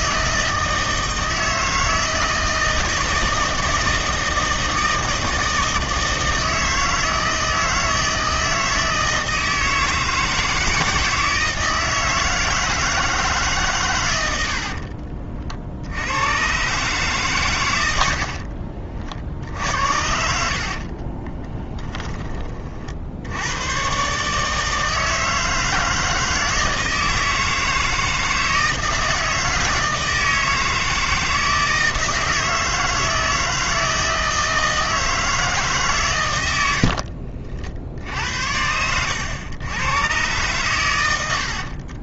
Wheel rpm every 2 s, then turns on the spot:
160, 160, 160, 160, 160, 160, 160, 70, 120, 50, 50, 40, 160, 160, 160, 160, 160, 160, 80, 80, 110.
14-16 18-22 36-38